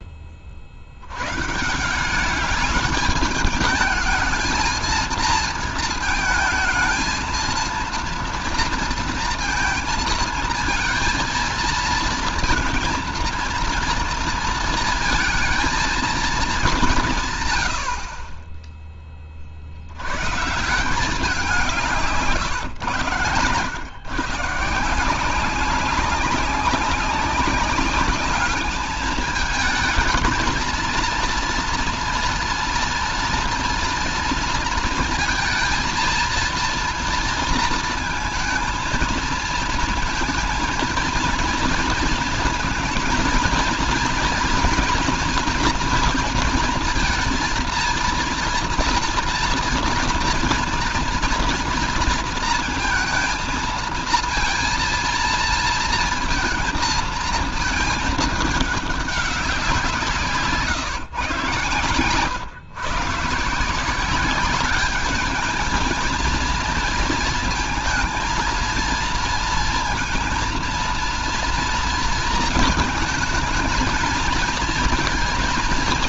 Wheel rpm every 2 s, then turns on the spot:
40, 200, 220, 220, 230, 230, 230, 230, 210, 20, 140, 140, 160, 190, 210, 230, 230, 230, 230, 230, 230, 230, 230, 230, 230, 230, 230, 230, 230, 210, 140, 120, 190, 230, 220, 230, 230, 230.
none